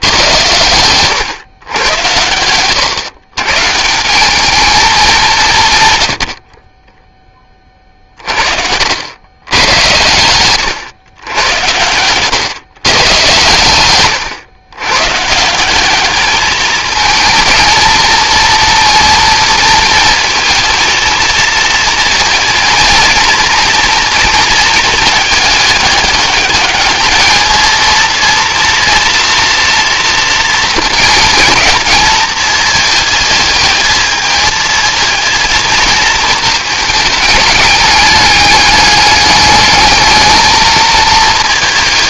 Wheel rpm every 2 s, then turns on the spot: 110, 120, 210, 20, 70, 110, 130, 120, 220, 230, 230, 230, 220, 210, 230, 230, 220, 220, 220, 210, 220.
6-8